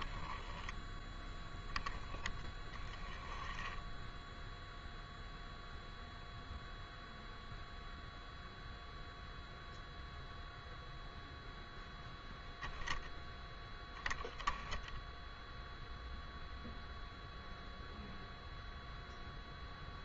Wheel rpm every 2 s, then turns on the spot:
10, 0, 0, 0, 0, 0, 10, 0, 0, 0.
none